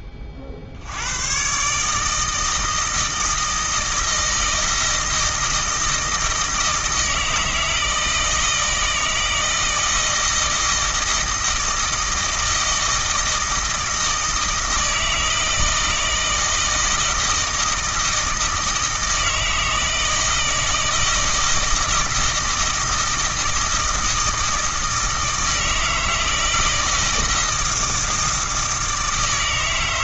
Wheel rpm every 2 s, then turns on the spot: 130, 160, 160, 160, 160, 160, 160, 160, 160, 160, 160, 160, 160, 160, 160.
none